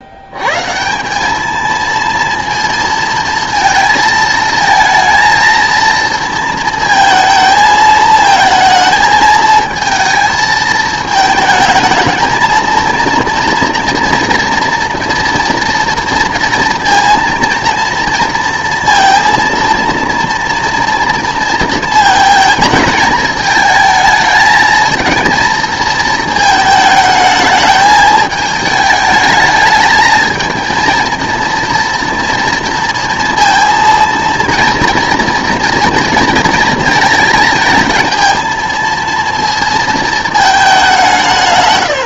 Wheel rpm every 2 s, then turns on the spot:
140, 230, 220, 220, 220, 220, 230, 230, 230, 230, 230, 220, 220, 220, 210, 230, 230, 240, 230, 230, 200.
none